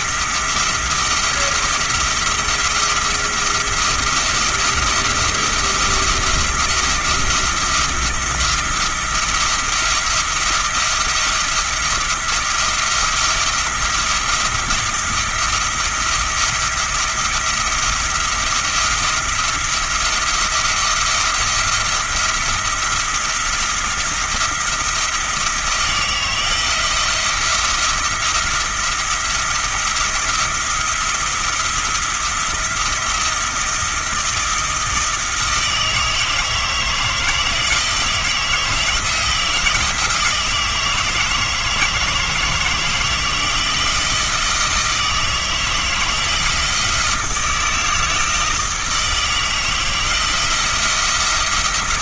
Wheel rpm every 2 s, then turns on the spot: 170, 170, 170, 170, 170, 170, 170, 170, 170, 170, 170, 170, 170, 170, 160, 170, 170, 170, 160, 160, 160, 160, 160, 170, 160, 170.
none